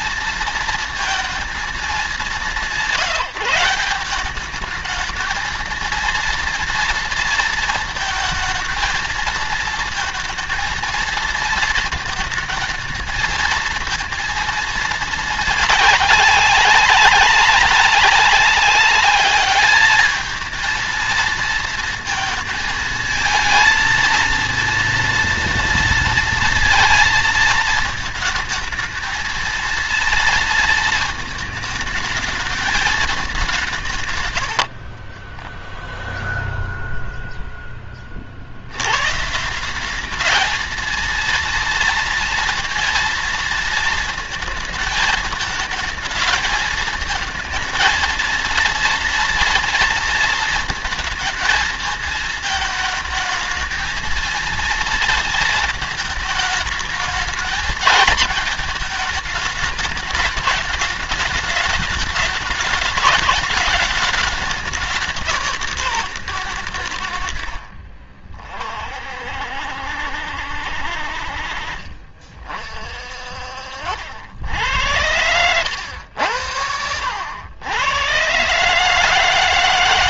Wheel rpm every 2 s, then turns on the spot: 230, 200, 210, 230, 230, 220, 220, 230, 200, 200, 220, 220, 230, 230, 220, 230, 210, 80, 0, 80, 220, 230, 220, 220, 230, 230, 220, 230, 220, 220, 210, 210, 200, 110, 30, 60, 50, 70, 80, 140.
34-36